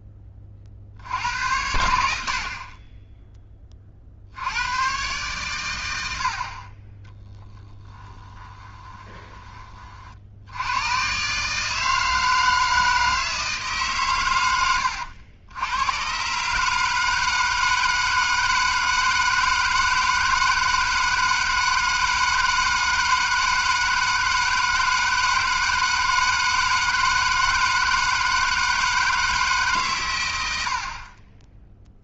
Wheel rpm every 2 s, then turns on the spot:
60, 30, 110, 40, 20, 100, 160, 90, 150, 160, 160, 160, 160, 160, 160, 70.
8-10